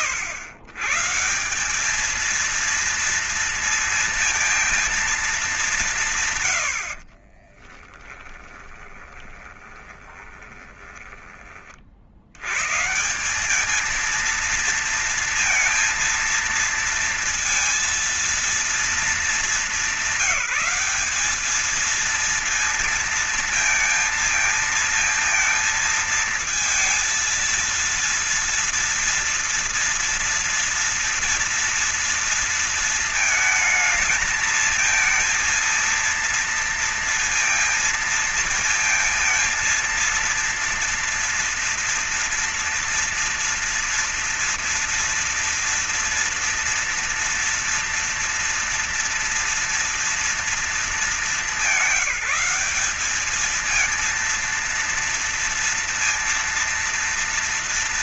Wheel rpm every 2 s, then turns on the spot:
130, 230, 230, 80, 20, 20, 120, 230, 230, 230, 190, 230, 230, 230, 230, 230, 230, 220, 230, 230, 230, 230, 230, 240, 230, 230, 210, 230, 230.
6-12